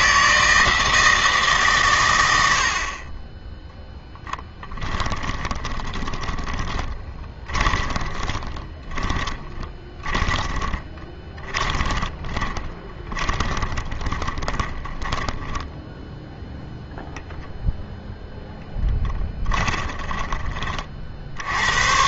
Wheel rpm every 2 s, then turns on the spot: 160, 80, 20, 20, 20, 20, 20, 20, 0, 10, 40.
4-16 18-20